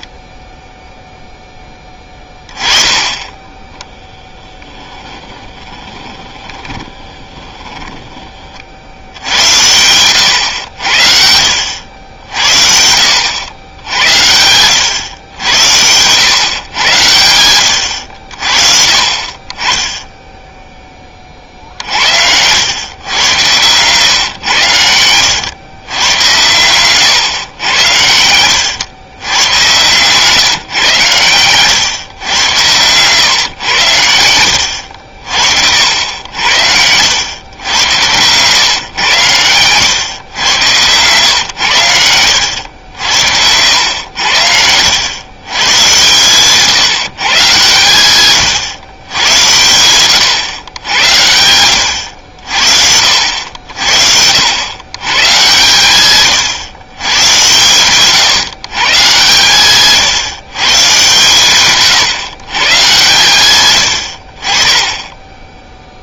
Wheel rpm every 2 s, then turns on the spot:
0, 20, 10, 20, 50, 90, 60, 100, 120, 50, 10, 100, 120, 100, 90, 140, 120, 90, 80, 120, 110, 80, 90, 140, 120, 100, 60, 100, 110, 140, 140, 120, 20.
4-8 32-36 40-42